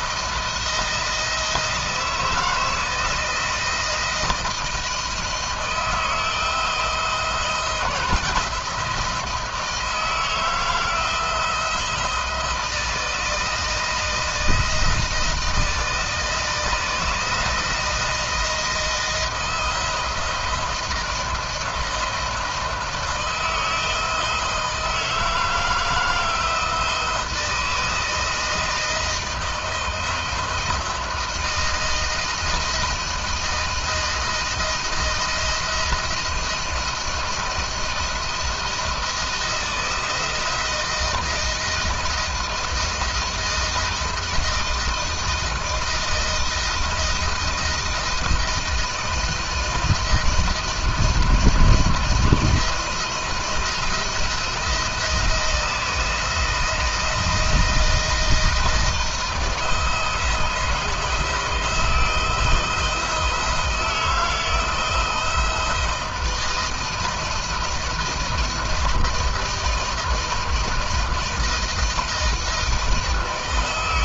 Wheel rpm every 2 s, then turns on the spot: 170, 170, 170, 160, 160, 160, 160, 160, 160, 170, 160, 160, 160, 160, 160, 160, 160, 170, 170, 170, 170, 160, 160, 160, 160, 160, 170, 170, 160, 170, 160, 170, 160, 160, 170, 160, 160.
none